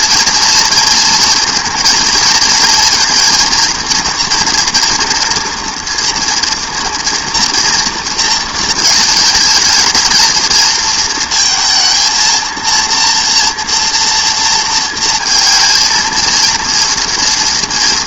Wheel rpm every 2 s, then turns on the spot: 230, 230, 240, 240, 230, 230, 230, 230, 230.
none